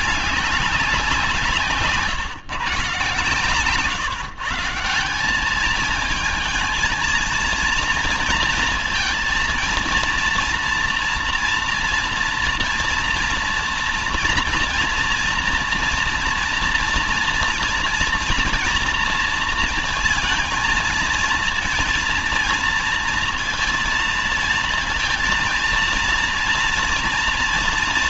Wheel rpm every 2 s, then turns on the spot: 180, 150, 160, 230, 230, 230, 230, 230, 230, 230, 230, 230, 230, 230.
none